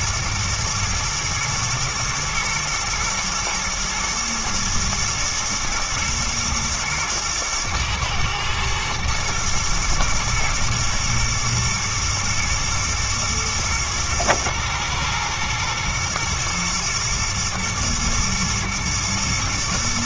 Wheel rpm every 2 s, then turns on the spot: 110, 110, 110, 120, 110, 110, 120, 120, 120, 120.
none